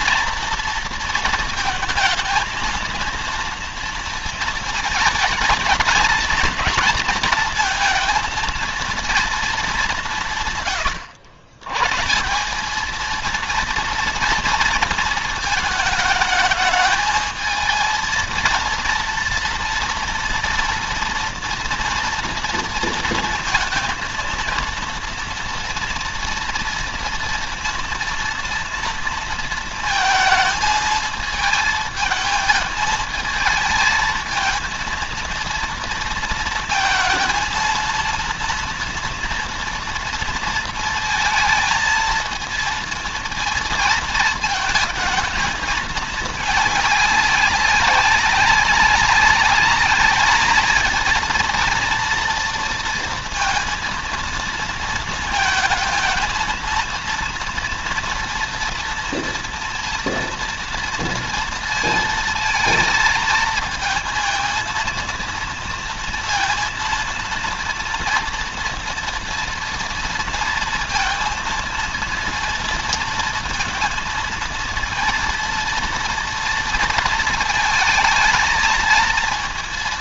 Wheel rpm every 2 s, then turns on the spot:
230, 230, 220, 220, 230, 120, 210, 230, 220, 230, 230, 230, 230, 230, 230, 220, 220, 230, 230, 230, 230, 230, 220, 210, 190, 220, 230, 230, 230, 230, 230, 230, 230, 230, 230, 230, 230, 230, 230, 230.
none